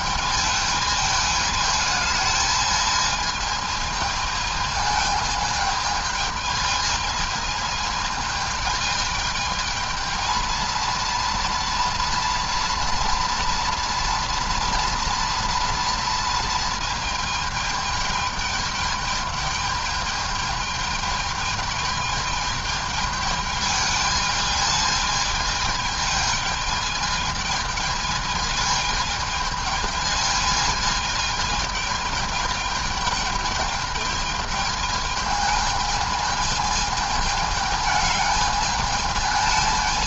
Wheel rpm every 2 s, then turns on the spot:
220, 210, 220, 220, 220, 230, 230, 230, 220, 210, 220, 210, 210, 210, 220, 220, 210, 210, 220, 210.
none